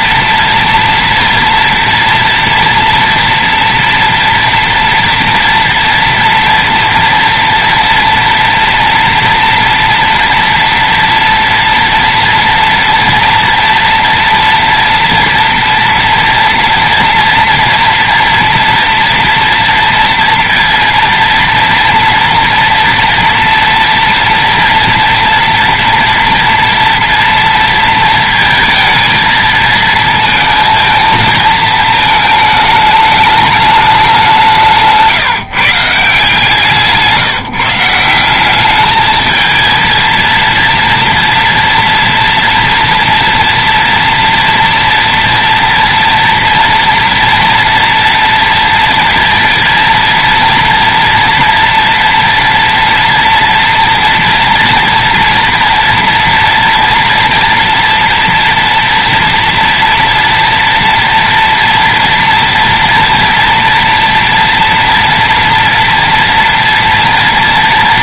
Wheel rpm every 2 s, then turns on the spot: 230, 240, 230, 230, 230, 230, 230, 230, 230, 230, 230, 230, 230, 230, 230, 230, 220, 180, 160, 180, 230, 230, 230, 230, 230, 230, 230, 230, 230, 230, 230, 230, 230, 230.
none